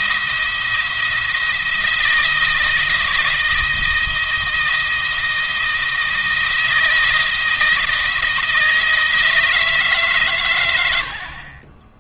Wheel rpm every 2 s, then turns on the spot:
170, 160, 170, 160, 160, 80.
none